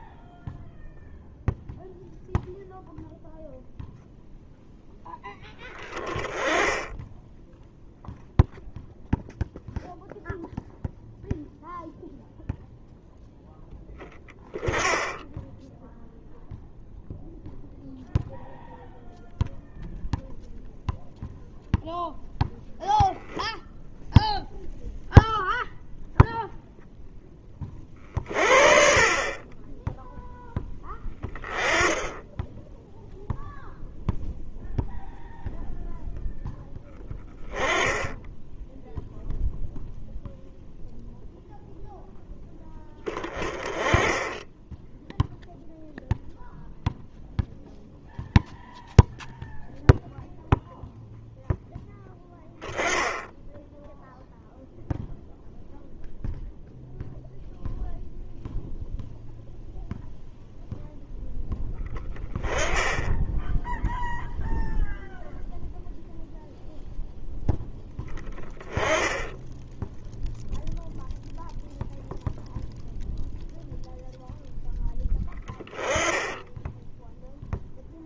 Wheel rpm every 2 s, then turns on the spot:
0, 0, 10, 10, 0, 0, 0, 20, 0, 0, 0, 0, 0, 0, 50, 10, 0, 0, 10, 0, 0, 10, 0, 0, 0, 0, 10, 0, 0, 0, 0, 10, 0, 0, 10, 0, 0, 10, 0.
none